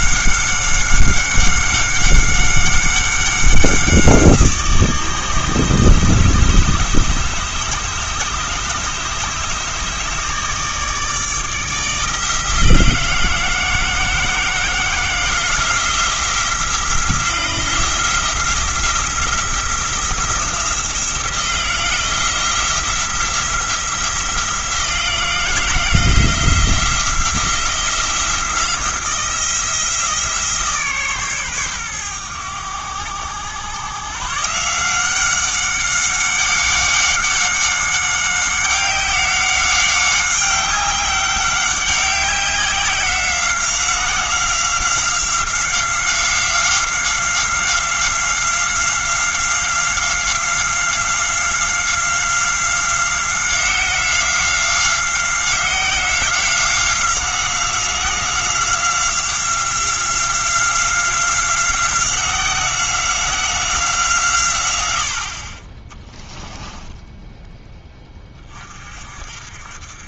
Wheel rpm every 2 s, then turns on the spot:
190, 190, 170, 150, 150, 150, 170, 170, 170, 170, 170, 170, 170, 170, 170, 150, 100, 160, 190, 190, 190, 190, 180, 180, 180, 180, 180, 180, 180, 180, 180, 180, 110, 20, 30.
66-68